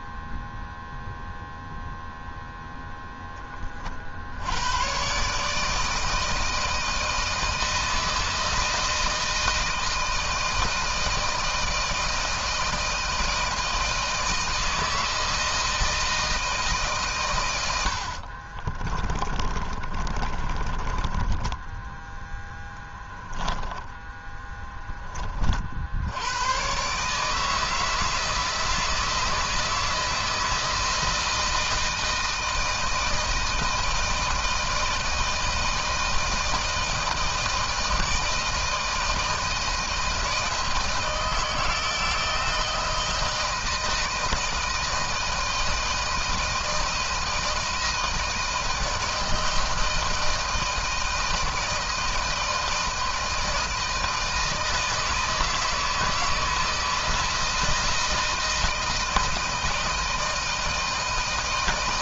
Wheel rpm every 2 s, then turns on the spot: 0, 0, 70, 160, 160, 160, 160, 160, 160, 50, 30, 10, 10, 90, 160, 160, 160, 160, 160, 160, 160, 160, 160, 160, 160, 160, 160, 160, 160, 160, 160.
18-22